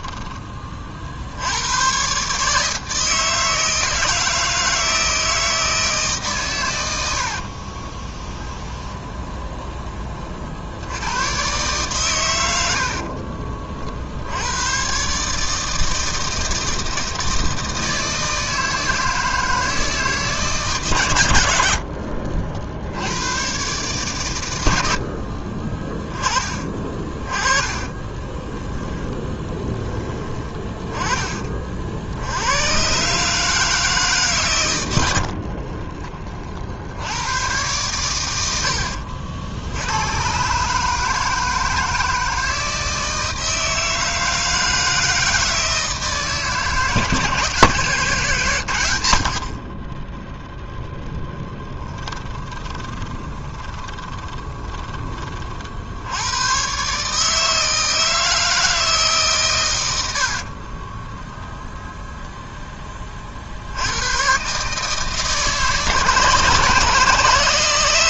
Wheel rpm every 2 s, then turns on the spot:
30, 160, 160, 110, 10, 60, 80, 110, 160, 160, 130, 70, 80, 30, 10, 20, 120, 110, 60, 70, 150, 160, 160, 160, 110, 0, 20, 20, 130, 160, 40, 20, 140, 150.
8-10 26-30 38-40 52-56 60-62